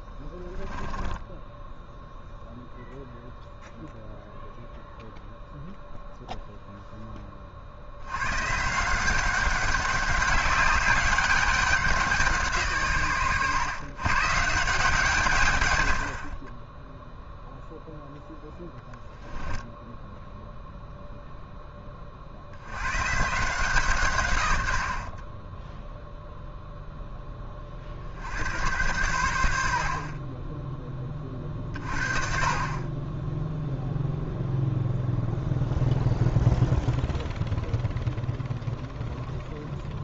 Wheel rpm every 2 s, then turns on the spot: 10, 0, 0, 0, 160, 200, 150, 160, 10, 0, 0, 90, 80, 0, 110, 20, 30, 0, 0, 0.
none